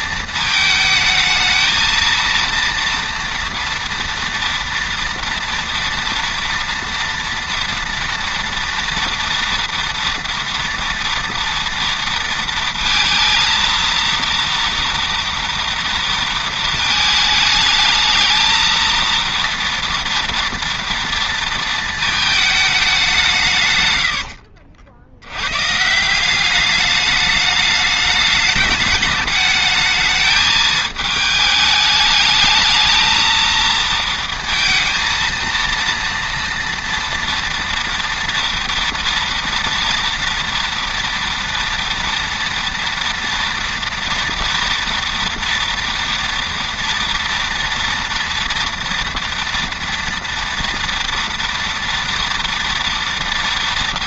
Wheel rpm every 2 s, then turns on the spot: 220, 230, 230, 230, 230, 230, 230, 230, 220, 220, 230, 210, 70, 200, 210, 220, 220, 230, 230, 230, 230, 230, 230, 230, 230, 230, 230.
none